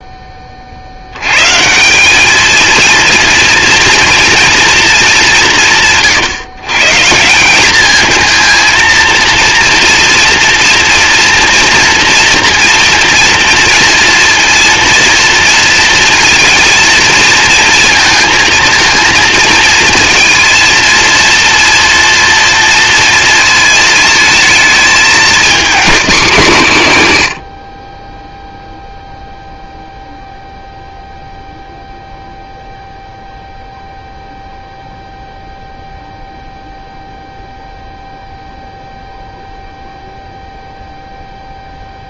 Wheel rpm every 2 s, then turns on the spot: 70, 220, 210, 160, 230, 240, 230, 230, 230, 220, 230, 230, 220, 120, 0, 0, 0, 0, 0, 0, 0.
none